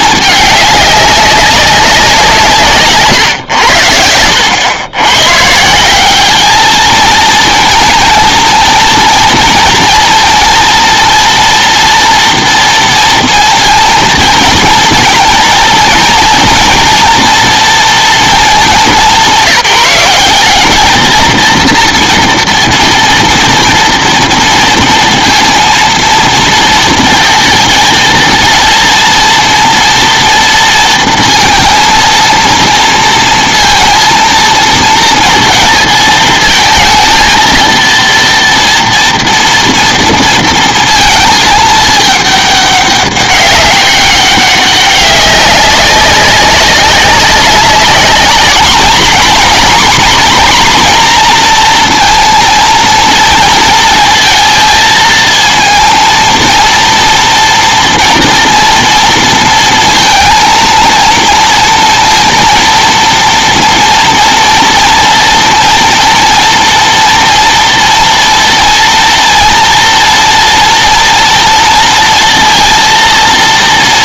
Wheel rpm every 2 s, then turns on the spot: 200, 140, 100, 210, 230, 230, 230, 230, 230, 210, 210, 240, 230, 230, 230, 230, 230, 230, 220, 230, 230, 210, 200, 190, 220, 240, 230, 230, 230, 230, 230, 230, 230, 230, 230, 230, 230.
none